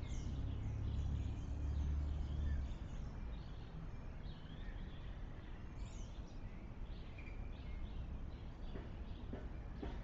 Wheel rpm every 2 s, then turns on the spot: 0, 0, 0, 0, 0.
none